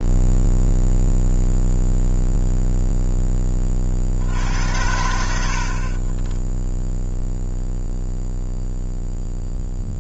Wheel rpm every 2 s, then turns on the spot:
0, 0, 80, 20, 0.
6-8